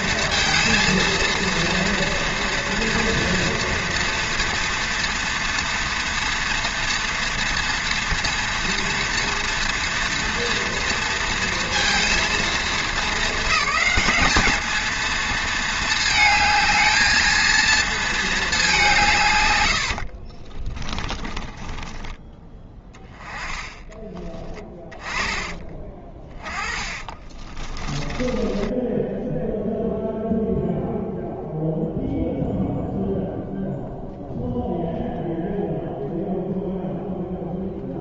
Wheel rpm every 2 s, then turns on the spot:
230, 230, 230, 230, 240, 230, 230, 220, 220, 200, 30, 20, 20, 30, 20, 0, 0, 0, 0.
20-22 24-30